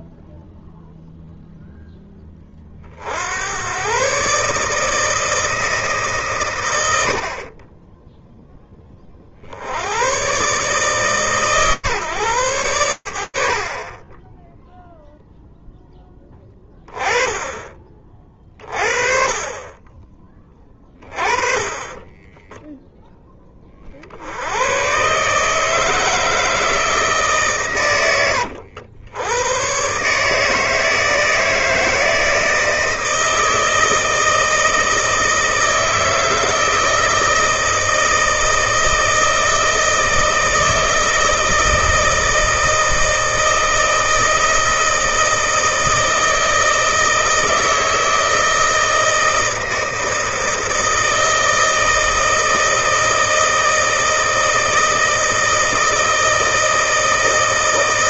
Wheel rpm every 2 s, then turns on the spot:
0, 70, 160, 60, 40, 140, 80, 0, 20, 30, 20, 30, 150, 130, 110, 160, 160, 160, 160, 160, 160, 160, 160, 160, 160, 160, 160, 160, 160.
none